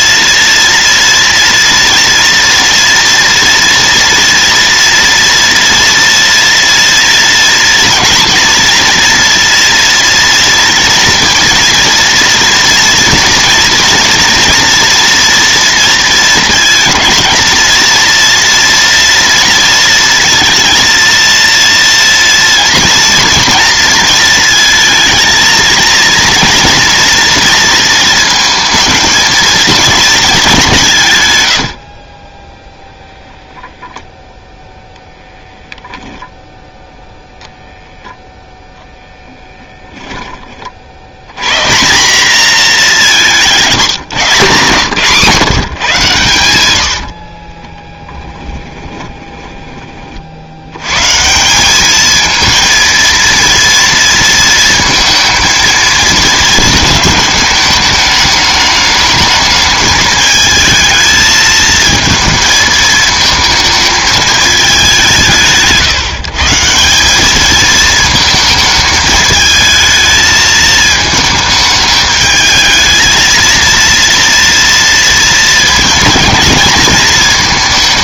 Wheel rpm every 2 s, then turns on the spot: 240, 230, 230, 230, 230, 230, 230, 230, 220, 230, 230, 240, 230, 230, 230, 190, 10, 0, 0, 0, 30, 220, 160, 100, 10, 80, 230, 230, 220, 210, 220, 220, 210, 160, 220, 220, 220, 230, 230.
48-50